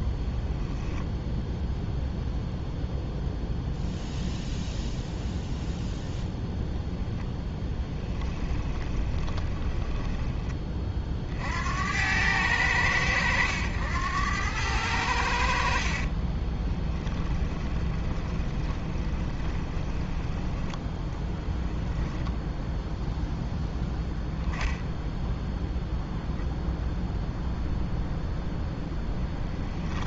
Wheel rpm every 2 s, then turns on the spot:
10, 0, 0, 0, 20, 20, 100, 100, 20, 20, 10, 0, 10, 0, 0.
0-2 8-10 16-20